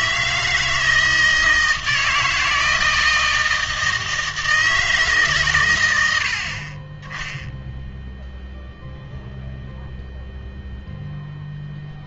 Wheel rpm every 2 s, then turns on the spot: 160, 160, 160, 60, 0, 0.
none